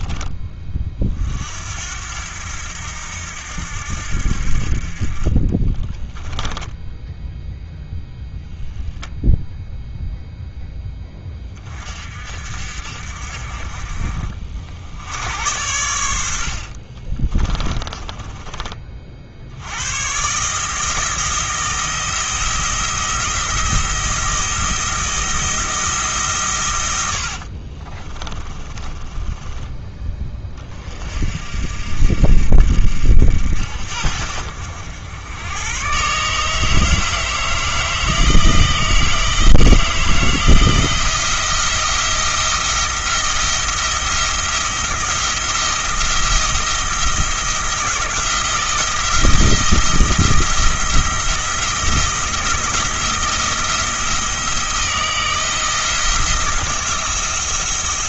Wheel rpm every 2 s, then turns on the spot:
30, 80, 50, 10, 0, 10, 60, 60, 60, 30, 150, 170, 170, 110, 20, 30, 60, 80, 150, 160, 170, 170, 170, 170, 170, 170, 160, 160, 170.
16-18 28-30